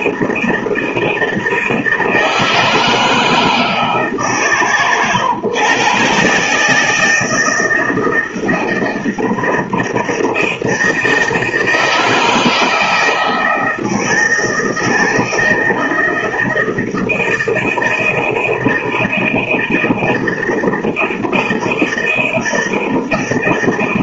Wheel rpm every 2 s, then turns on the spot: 160, 160, 140, 140, 160, 160, 160, 160, 160, 160, 160, 160.
none